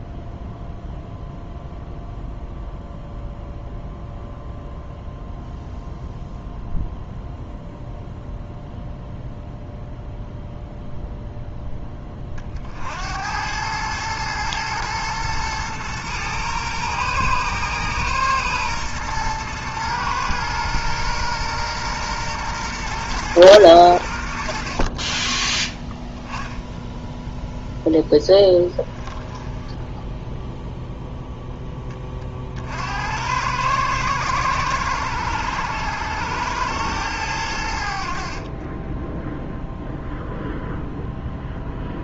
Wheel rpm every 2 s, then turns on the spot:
0, 0, 0, 0, 0, 0, 50, 110, 120, 120, 120, 120, 70, 10, 10, 0, 60, 100, 110, 30, 0.
28-30 38-40